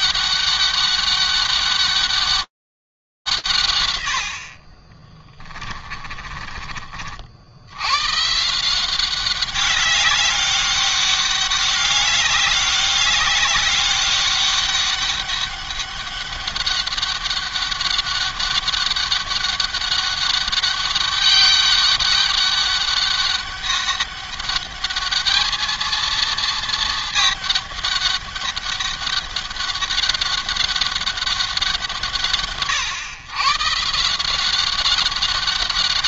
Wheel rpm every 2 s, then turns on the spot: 200, 200, 60, 50, 160, 200, 200, 200, 200, 200, 200, 200, 210, 220, 200, 200, 140, 190.
none